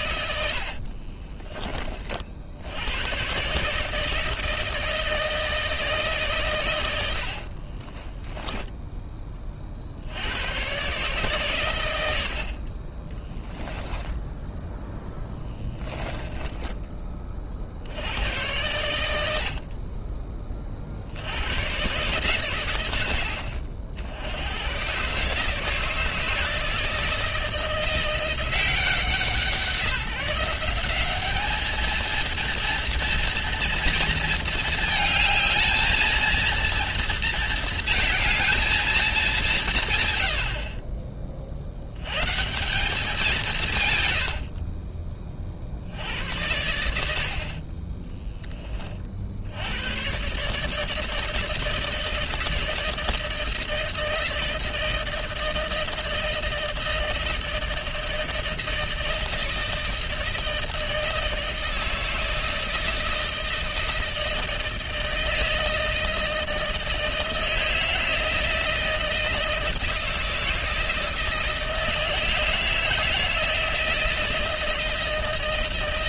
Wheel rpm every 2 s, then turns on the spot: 60, 80, 160, 110, 10, 130, 30, 0, 10, 90, 50, 90, 110, 160, 170, 190, 230, 220, 230, 230, 50, 170, 30, 80, 20, 150, 160, 160, 160, 160, 160, 160, 160, 160, 160, 160, 160, 160.
0-2 16-18